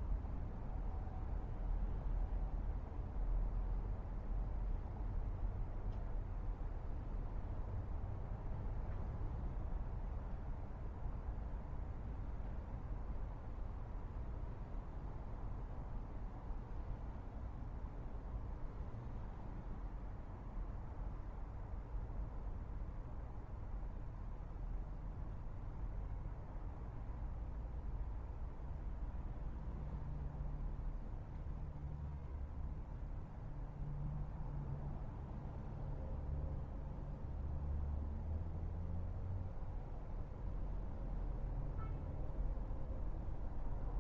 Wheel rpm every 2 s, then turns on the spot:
0, 0, 0, 0, 0, 0, 0, 0, 0, 0, 0, 0, 0, 0, 0, 0, 0, 0, 0, 0, 0, 0.
none